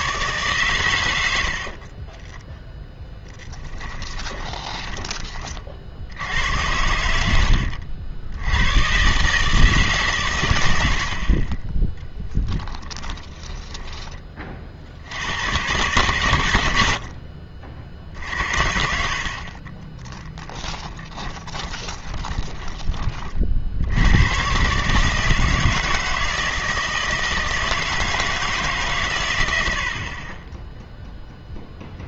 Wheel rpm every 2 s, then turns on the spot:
120, 0, 10, 90, 110, 110, 10, 40, 90, 50, 10, 20, 130, 160, 150, 10.
4-6 10-14 18-22